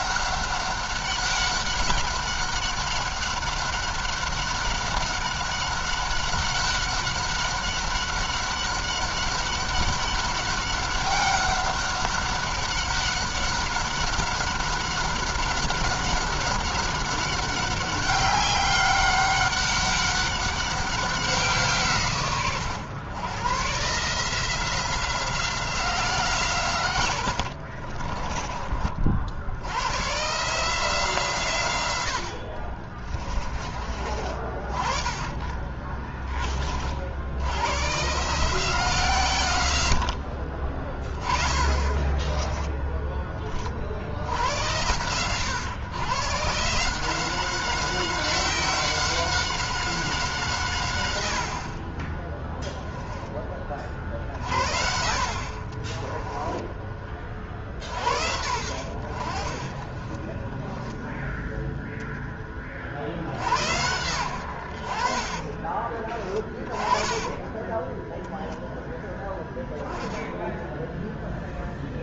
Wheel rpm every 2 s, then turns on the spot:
190, 190, 190, 200, 200, 200, 200, 200, 200, 190, 190, 120, 170, 130, 40, 150, 60, 30, 40, 150, 50, 10, 90, 140, 190, 140, 10, 50, 20, 70, 10, 40, 80, 20, 0, 10.
32-34 52-54 56-58 60-62 66-68